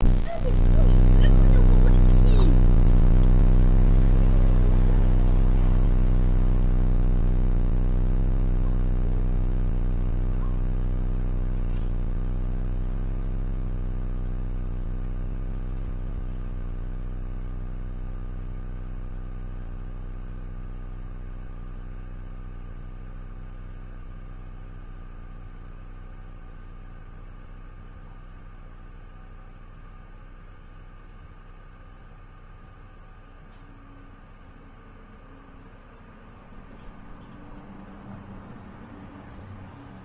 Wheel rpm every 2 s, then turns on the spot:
0, 0, 0, 0, 0, 0, 0, 0, 0, 0, 0, 0, 0, 0, 0, 0, 0, 0, 0, 0.
none